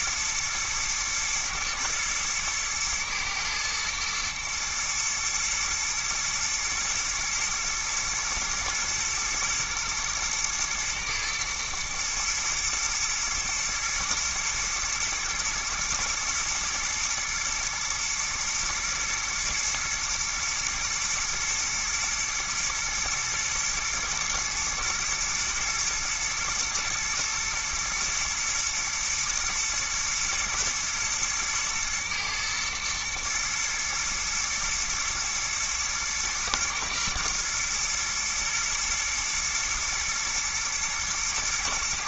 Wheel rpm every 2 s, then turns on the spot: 110, 110, 120, 120, 120, 120, 120, 120, 120, 120, 110, 110, 110, 120, 120, 110, 110, 120, 120, 110, 110.
none